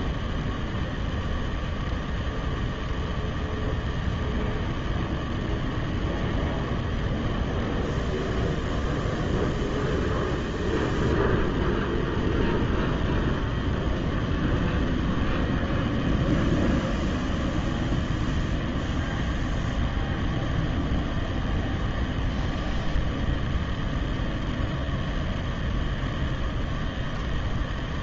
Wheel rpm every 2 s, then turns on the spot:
0, 0, 0, 0, 0, 0, 0, 0, 0, 0, 0, 0, 0, 0.
none